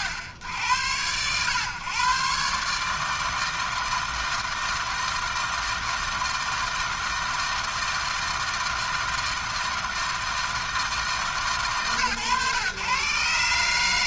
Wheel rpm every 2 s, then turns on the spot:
80, 140, 160, 160, 160, 160, 120.
none